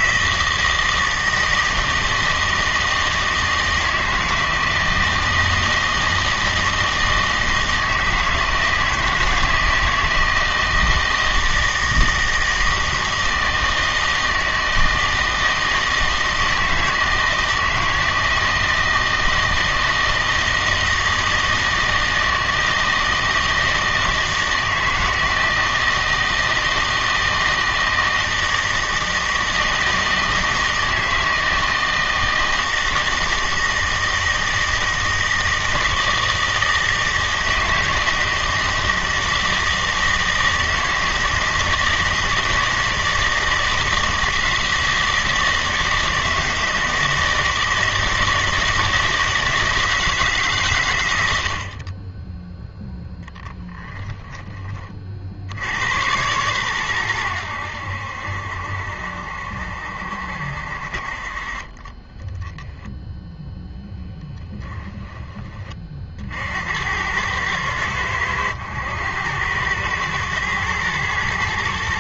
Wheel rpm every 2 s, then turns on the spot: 160, 160, 160, 160, 160, 160, 160, 160, 160, 160, 160, 160, 160, 160, 160, 160, 160, 160, 160, 160, 160, 160, 160, 160, 160, 130, 0, 20, 110, 70, 60, 0, 10, 80, 100, 120.
none